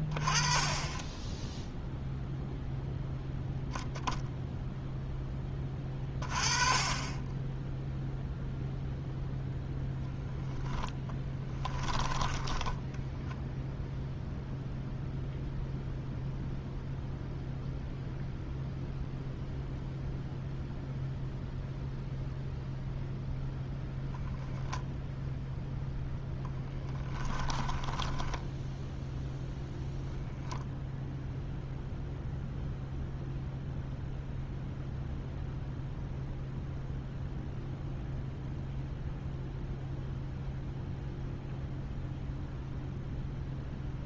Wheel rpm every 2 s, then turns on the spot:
20, 0, 0, 20, 0, 0, 10, 0, 0, 0, 0, 0, 0, 10, 0, 0, 0, 0, 0, 0, 0, 0.
12-14 26-28